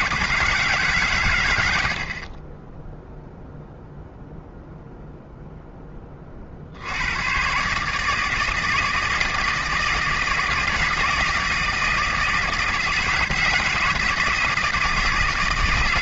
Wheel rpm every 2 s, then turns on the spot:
0, 0, 80, 160, 160, 160, 160, 160.
none